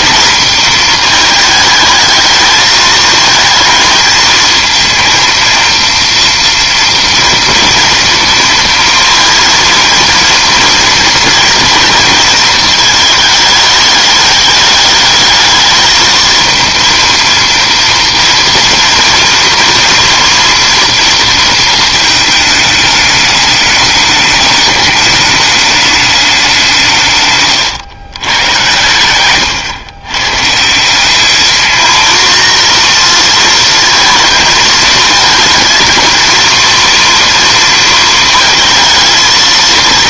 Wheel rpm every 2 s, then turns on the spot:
230, 220, 230, 230, 230, 230, 220, 210, 230, 230, 230, 210, 210, 180, 110, 160, 230, 220, 230, 230.
none